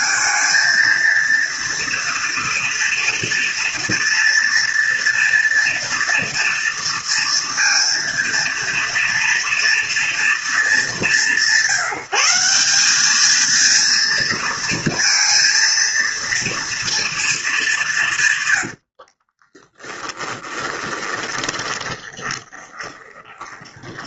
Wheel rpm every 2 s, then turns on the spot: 230, 230, 230, 230, 230, 190, 210, 230, 230, 60, 20, 10.
18-24